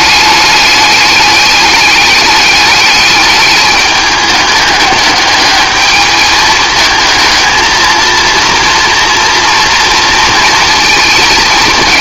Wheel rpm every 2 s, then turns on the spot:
210, 210, 210, 220, 230, 230.
none